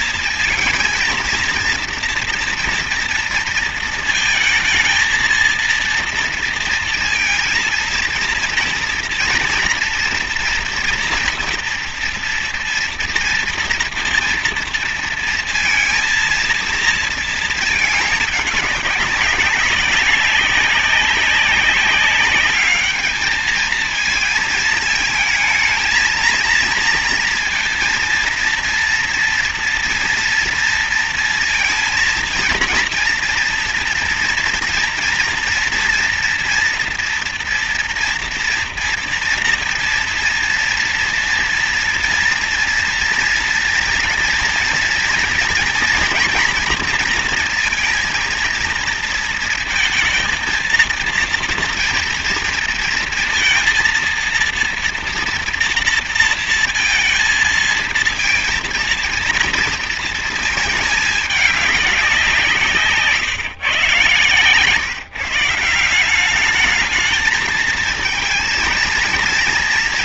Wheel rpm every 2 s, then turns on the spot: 230, 230, 220, 230, 230, 230, 230, 230, 230, 200, 200, 210, 220, 230, 230, 230, 230, 230, 240, 230, 230, 240, 230, 230, 230, 230, 230, 230, 230, 230, 220, 170, 130, 200, 230.
none